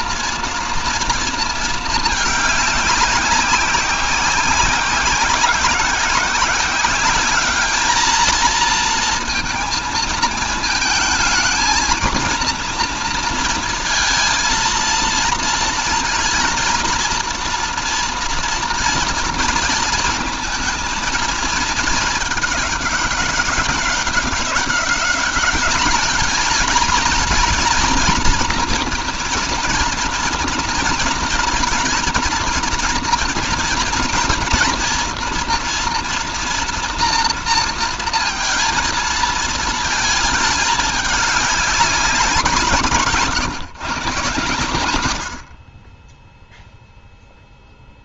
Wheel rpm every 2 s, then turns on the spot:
230, 200, 190, 190, 230, 220, 240, 230, 230, 230, 230, 210, 190, 220, 230, 230, 230, 230, 230, 230, 220, 160, 120, 0.
none